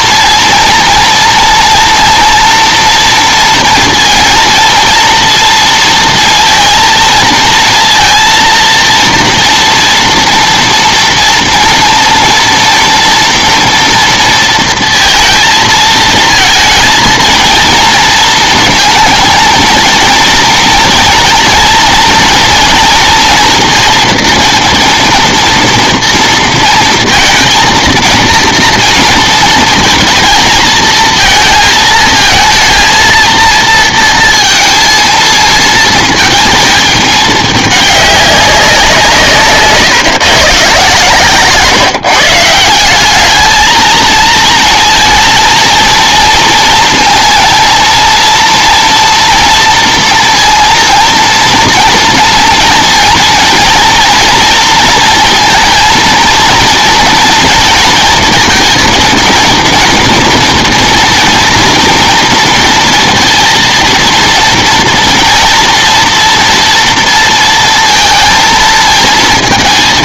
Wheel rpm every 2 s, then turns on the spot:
230, 230, 230, 230, 230, 230, 230, 230, 230, 230, 230, 240, 230, 230, 230, 220, 230, 230, 220, 190, 140, 170, 230, 230, 240, 230, 230, 230, 230, 230, 230, 230, 230, 230, 230.
none